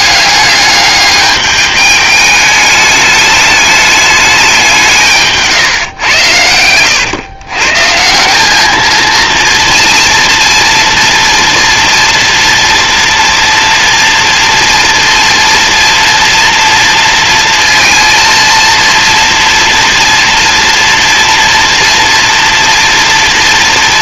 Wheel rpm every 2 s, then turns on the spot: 200, 210, 150, 120, 230, 230, 230, 230, 230, 230, 230, 230.
none